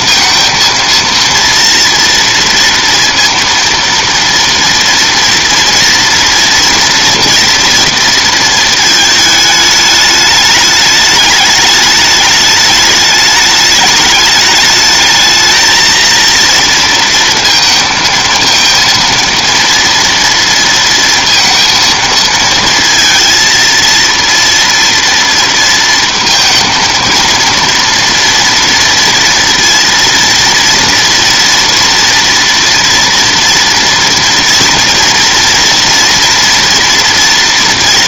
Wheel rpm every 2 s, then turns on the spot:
230, 230, 230, 230, 220, 210, 210, 210, 230, 230, 230, 230, 230, 230, 230, 230, 230, 230, 240.
none